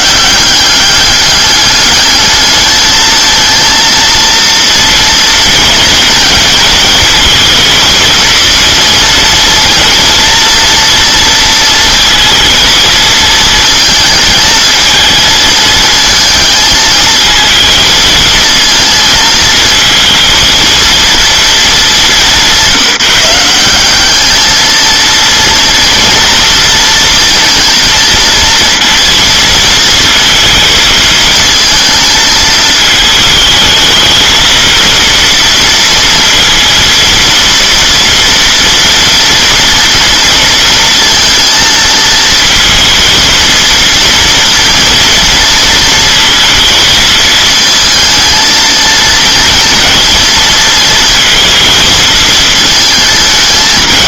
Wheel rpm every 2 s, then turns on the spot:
200, 220, 230, 230, 230, 230, 220, 220, 220, 220, 230, 190, 230, 230, 230, 220, 220, 230, 230, 230, 230, 230, 230, 220, 230, 230, 220.
none